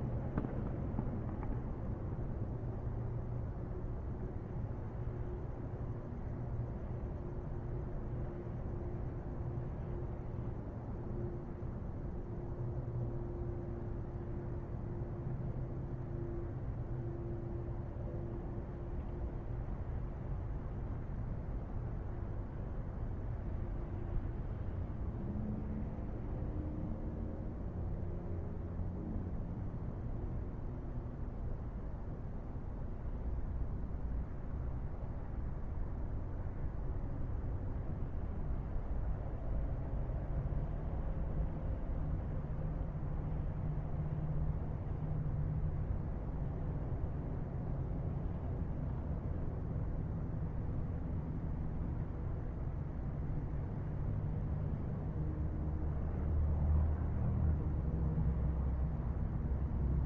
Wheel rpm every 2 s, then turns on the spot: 0, 0, 0, 0, 0, 0, 0, 0, 0, 0, 0, 0, 0, 0, 0, 0, 0, 0, 0, 0, 0, 0, 0, 0, 0, 0, 0, 0, 0, 0.
none